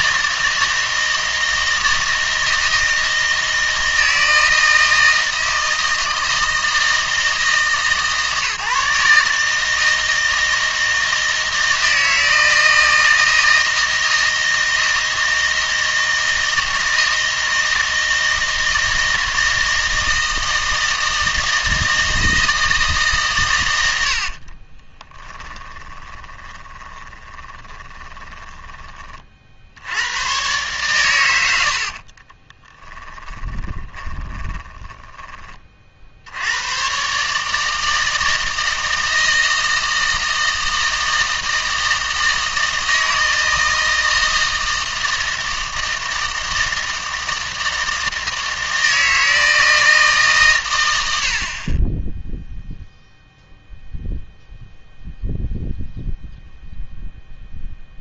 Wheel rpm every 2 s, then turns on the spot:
160, 160, 160, 160, 150, 160, 160, 160, 160, 160, 160, 160, 30, 20, 20, 120, 10, 20, 90, 160, 160, 160, 160, 160, 160, 110, 0, 0, 0.
24-30 32-36